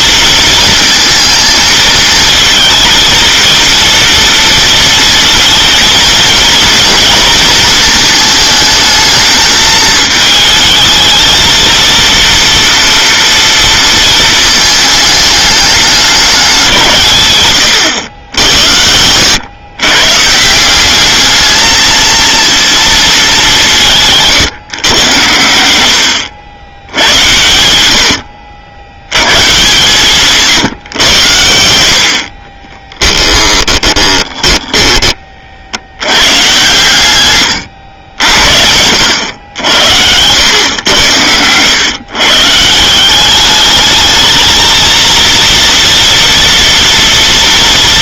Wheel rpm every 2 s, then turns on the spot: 230, 230, 230, 230, 220, 220, 230, 220, 190, 90, 170, 230, 140, 90, 80, 140, 40, 10, 120, 80, 100, 150, 220, 240.
32-36